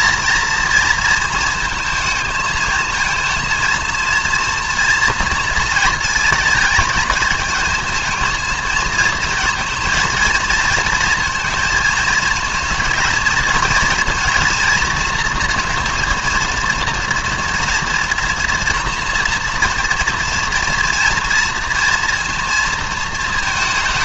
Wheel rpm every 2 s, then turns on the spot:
230, 220, 230, 220, 220, 230, 230, 230, 230, 230, 240, 230.
none